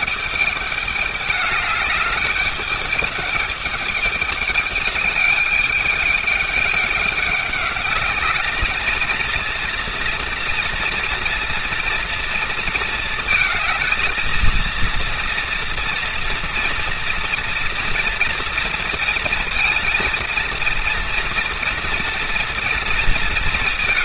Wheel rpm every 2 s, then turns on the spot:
210, 210, 210, 210, 220, 230, 230, 230, 230, 230, 230, 230.
none